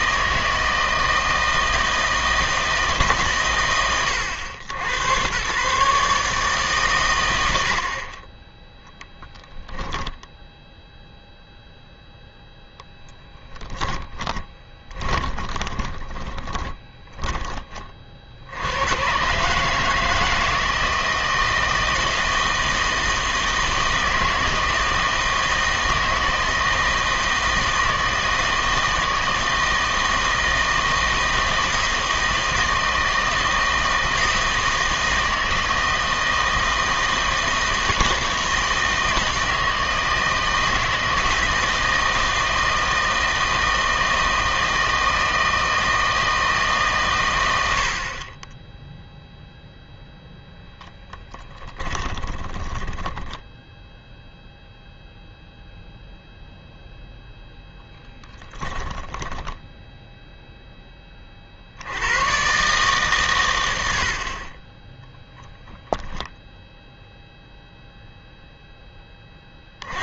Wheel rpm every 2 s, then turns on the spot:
160, 160, 90, 140, 10, 0, 0, 20, 20, 90, 160, 160, 160, 160, 160, 160, 160, 160, 160, 160, 160, 160, 160, 150, 10, 0, 10, 0, 0, 10, 0, 130, 20, 0, 0.
14-18 52-54